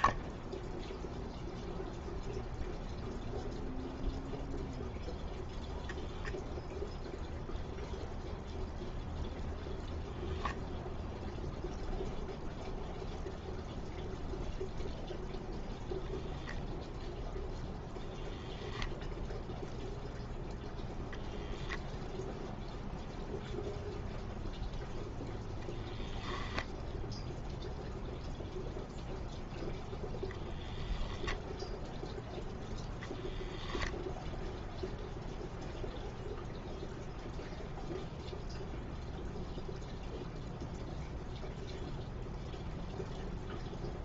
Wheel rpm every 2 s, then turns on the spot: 0, 0, 0, 0, 0, 0, 0, 0, 0, 0, 0, 0, 0, 0, 0, 10, 0, 0, 0, 0, 0, 0.
none